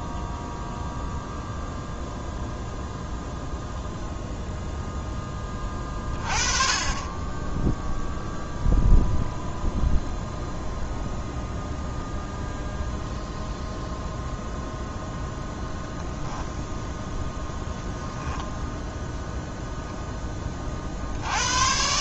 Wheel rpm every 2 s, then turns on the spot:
0, 0, 0, 30, 0, 0, 0, 0, 0, 0, 20.
none